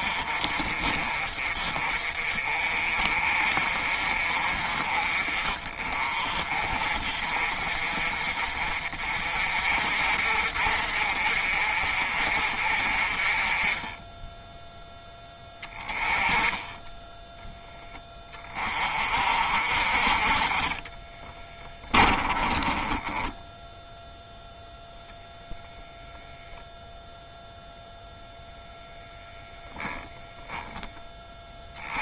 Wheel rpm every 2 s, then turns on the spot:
40, 40, 40, 40, 40, 50, 40, 10, 10, 40, 20, 20, 0, 0, 0, 10.
20-24